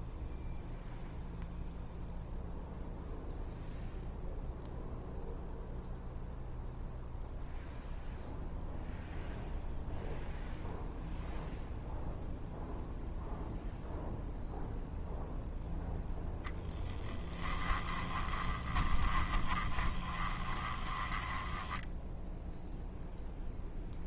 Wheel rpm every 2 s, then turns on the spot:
0, 0, 0, 0, 0, 0, 0, 0, 0, 20, 20, 0.
18-22